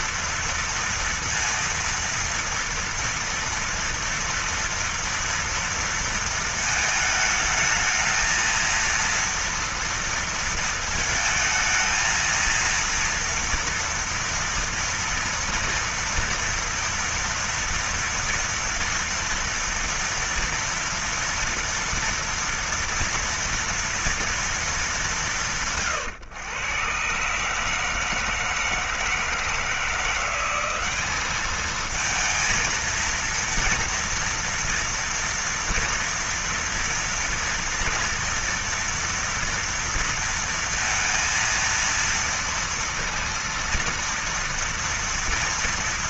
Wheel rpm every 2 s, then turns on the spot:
230, 230, 230, 220, 230, 230, 230, 230, 230, 230, 230, 230, 220, 120, 160, 190, 230, 230, 230, 230, 230, 230, 230.
none